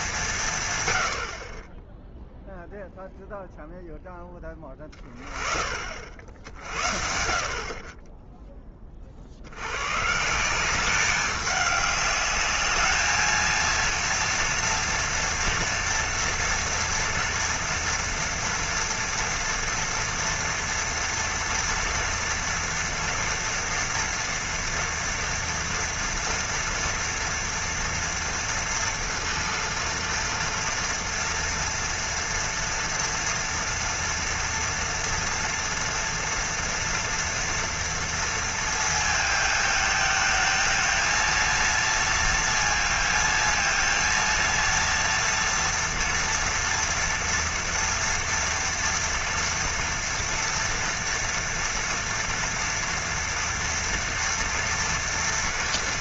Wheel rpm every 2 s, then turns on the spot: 140, 0, 20, 60, 20, 180, 210, 230, 230, 230, 230, 230, 230, 240, 230, 230, 230, 230, 230, 230, 220, 230, 230, 230, 230, 230, 230, 230.
none